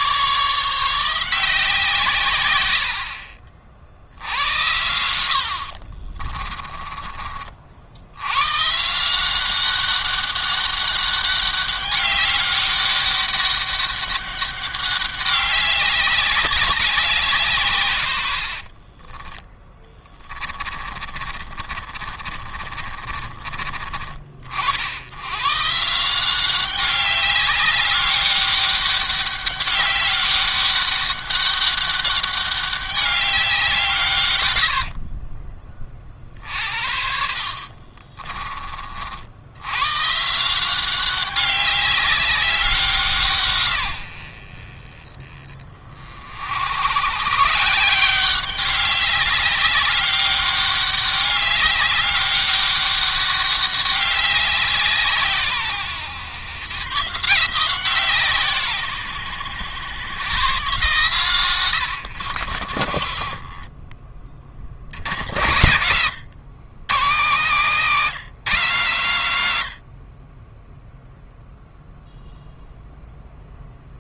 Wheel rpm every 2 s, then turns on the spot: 170, 80, 80, 30, 150, 200, 200, 200, 190, 40, 30, 40, 90, 200, 200, 200, 200, 60, 60, 60, 190, 180, 30, 100, 190, 200, 200, 170, 140, 130, 140, 60, 80, 130, 150, 0, 0.
4-6 18-24 34-38 62-64